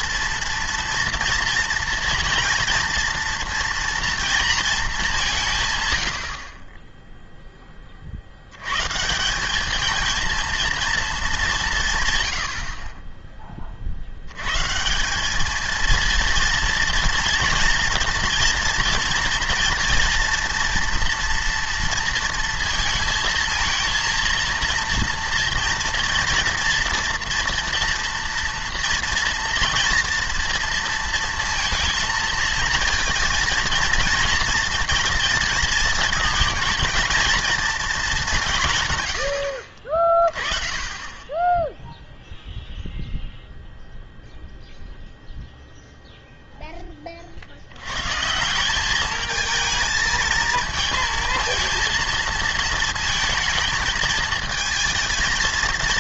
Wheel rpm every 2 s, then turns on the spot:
230, 230, 220, 30, 120, 230, 50, 140, 230, 230, 230, 230, 230, 230, 230, 230, 230, 240, 230, 150, 20, 0, 0, 10, 180, 230, 220, 220.
none